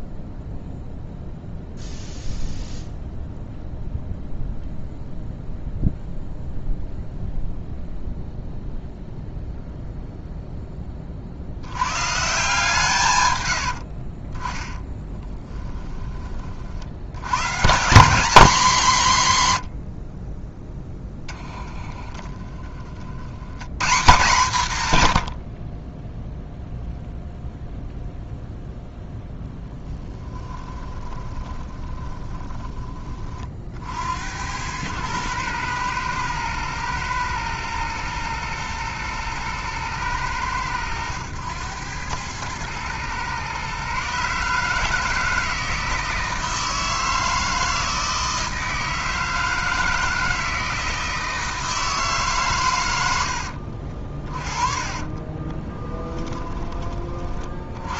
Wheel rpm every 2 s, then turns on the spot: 0, 0, 0, 0, 0, 20, 150, 20, 60, 210, 10, 30, 130, 0, 0, 20, 20, 100, 110, 120, 100, 110, 150, 160, 160, 160, 100, 40, 20.
14-16 22-24 30-32 54-56